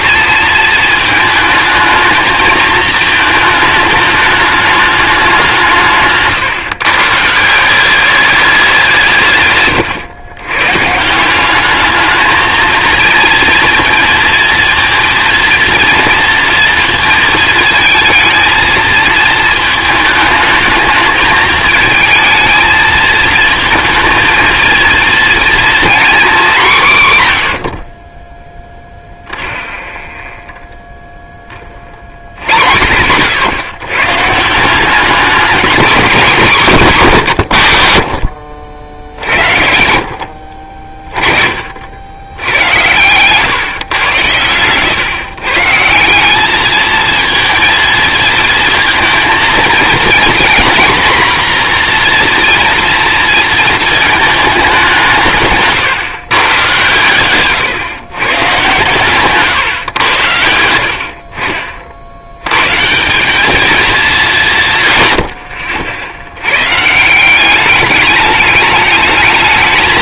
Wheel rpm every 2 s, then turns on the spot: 220, 220, 210, 150, 190, 130, 230, 230, 230, 220, 220, 220, 230, 190, 0, 0, 100, 180, 220, 80, 50, 100, 110, 210, 220, 240, 240, 190, 120, 140, 70, 130, 170, 130, 220.
42-44